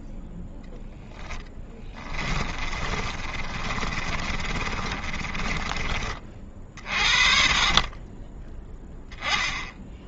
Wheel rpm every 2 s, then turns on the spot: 0, 30, 30, 40, 10.
2-6